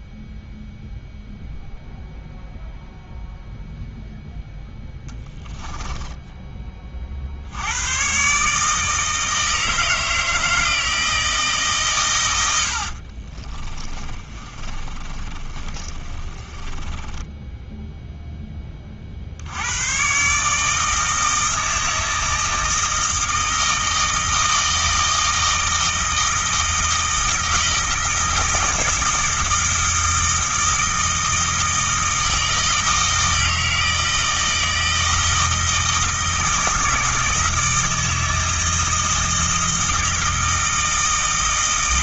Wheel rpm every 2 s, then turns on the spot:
0, 0, 0, 20, 150, 160, 80, 30, 30, 20, 150, 160, 160, 160, 160, 160, 160, 160, 160, 160, 160.
12-18